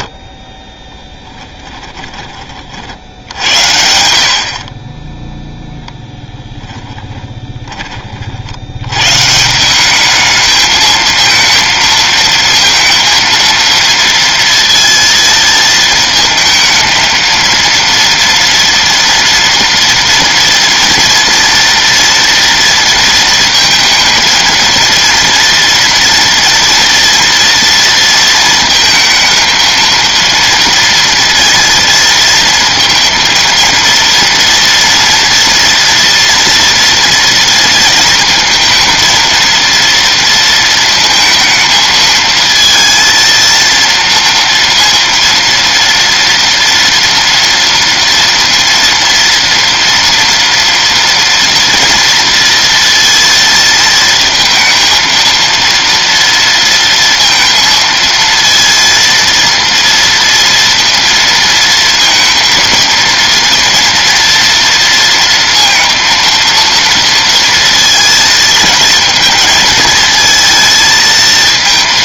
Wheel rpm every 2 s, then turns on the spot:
30, 40, 50, 20, 70, 220, 230, 230, 230, 230, 240, 230, 220, 230, 230, 230, 230, 230, 240, 220, 230, 230, 230, 230, 230, 230, 230, 230, 230, 230, 230, 230, 230, 230, 220, 220.
0-2 6-8